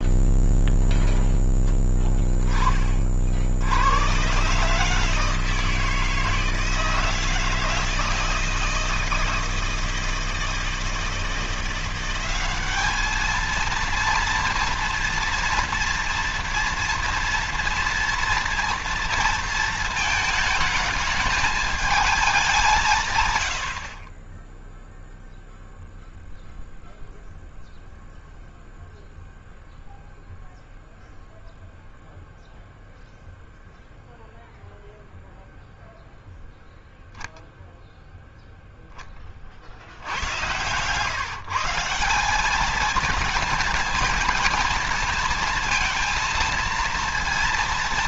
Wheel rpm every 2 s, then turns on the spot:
0, 40, 150, 160, 160, 160, 200, 230, 230, 230, 220, 140, 0, 0, 0, 0, 0, 0, 0, 10, 130, 220, 230, 220.
none